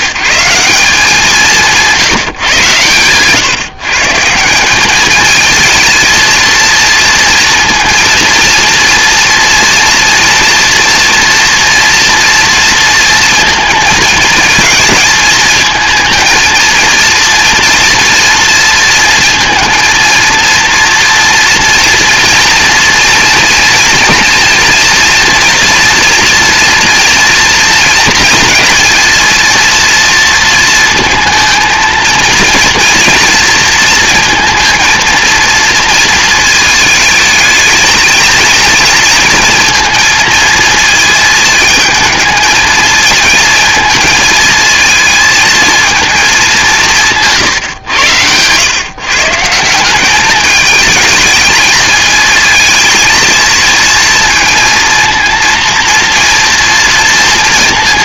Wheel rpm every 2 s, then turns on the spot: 180, 130, 200, 230, 230, 230, 230, 220, 220, 230, 230, 230, 230, 230, 230, 230, 230, 230, 220, 230, 230, 220, 220, 180, 130, 210, 220, 230, 230.
none